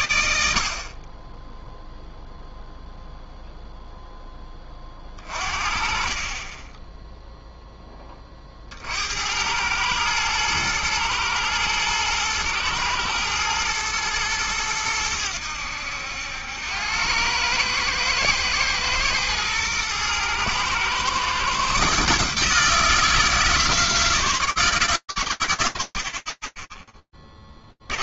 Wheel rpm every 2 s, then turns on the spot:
90, 0, 0, 50, 0, 100, 110, 110, 90, 110, 110, 140, 130, 80.
none